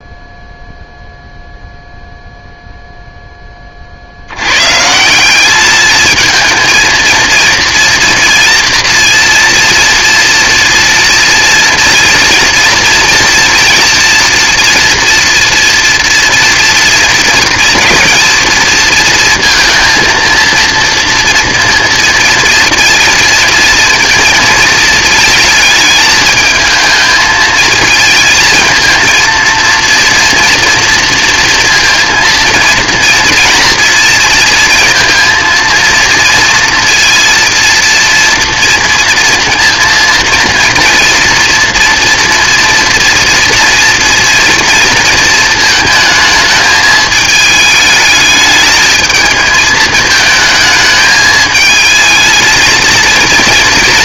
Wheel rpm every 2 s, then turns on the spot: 0, 0, 130, 230, 230, 230, 230, 240, 230, 230, 230, 230, 230, 220, 220, 230, 230, 230, 230, 230, 230, 230, 240, 220, 220, 220, 230.
none